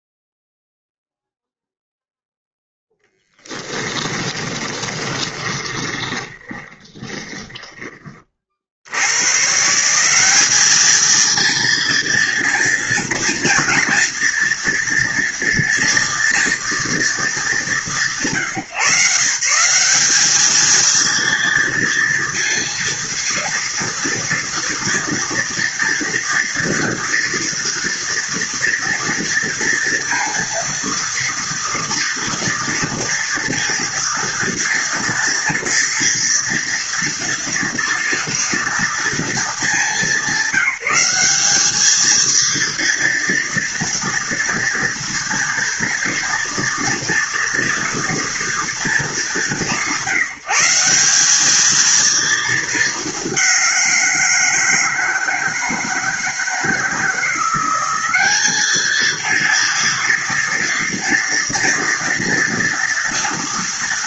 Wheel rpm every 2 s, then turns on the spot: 0, 0, 20, 20, 40, 200, 230, 230, 230, 160, 220, 230, 230, 230, 230, 230, 240, 230, 230, 230, 210, 230, 230, 230, 210, 170, 220, 170, 160, 210, 230, 240.
4-8